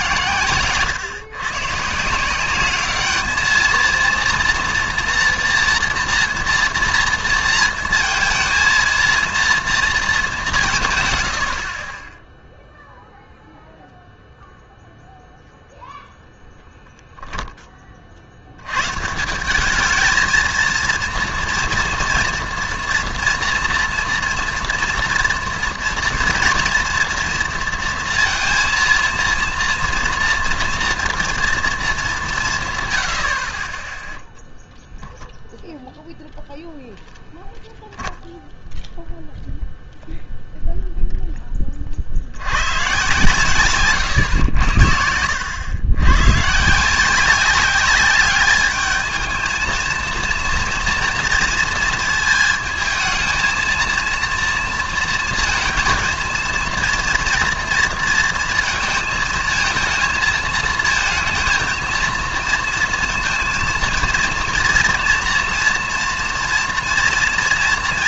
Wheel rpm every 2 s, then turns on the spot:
120, 190, 230, 230, 230, 180, 0, 0, 10, 90, 230, 230, 230, 230, 230, 230, 150, 0, 0, 0, 0, 100, 80, 140, 210, 230, 220, 230, 230, 230, 230, 230, 230, 230.
none